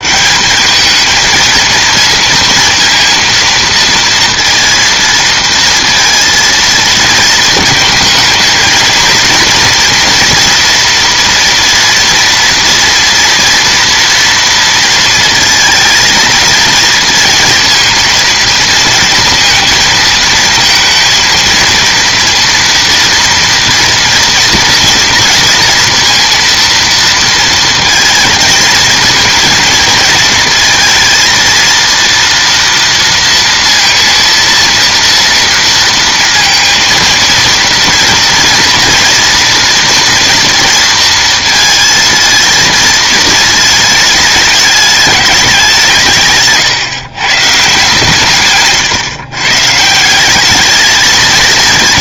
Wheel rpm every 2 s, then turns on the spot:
200, 230, 230, 230, 220, 240, 230, 230, 230, 230, 230, 230, 230, 230, 230, 220, 230, 230, 230, 240, 230, 220, 210, 130, 130, 210.
48-50